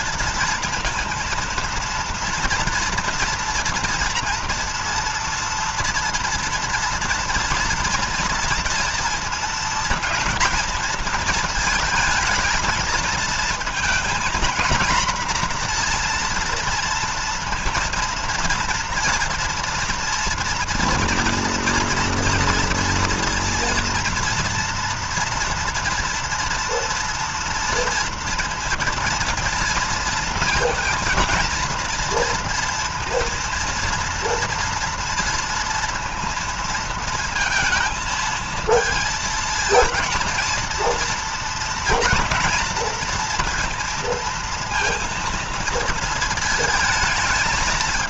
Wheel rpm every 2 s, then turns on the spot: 230, 230, 230, 230, 230, 230, 220, 230, 230, 230, 240, 230, 230, 230, 230, 230, 230, 230, 230, 220, 230, 230, 230, 220.
none